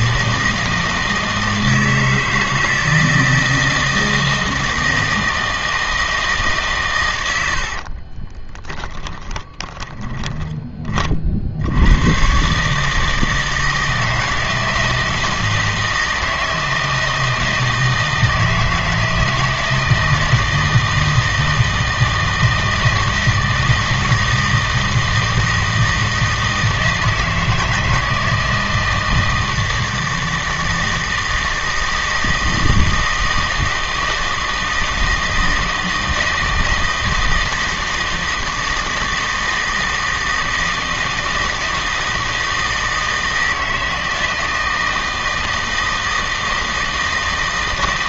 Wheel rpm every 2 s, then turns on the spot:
160, 160, 160, 150, 10, 30, 150, 160, 160, 160, 160, 160, 160, 160, 160, 160, 160, 160, 160, 160, 160, 160, 160, 160.
8-10